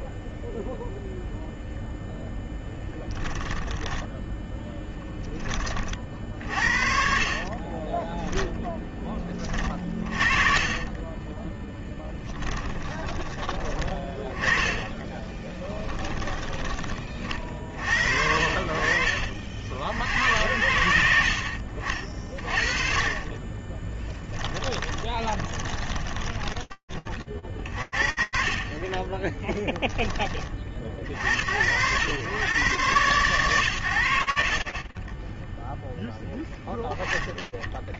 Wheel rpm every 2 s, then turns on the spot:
0, 10, 10, 40, 10, 30, 20, 10, 40, 50, 70, 40, 30, 40, 10, 110, 30, 10, 20.
2-4 6-8 10-12 14-16 24-26 32-34